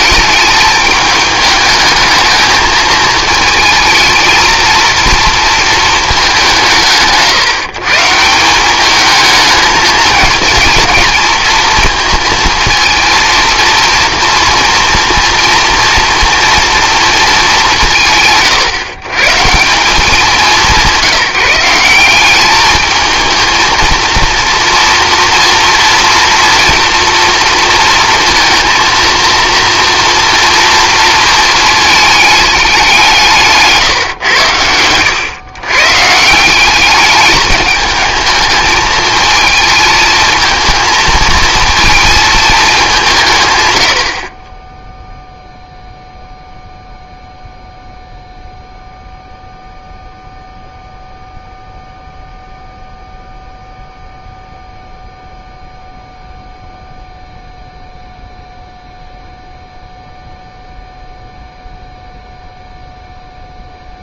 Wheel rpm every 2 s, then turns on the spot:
210, 220, 230, 170, 200, 220, 230, 230, 230, 130, 190, 220, 230, 230, 230, 230, 190, 100, 200, 220, 220, 200, 10, 0, 0, 0, 0, 0, 0, 0, 0, 0.
none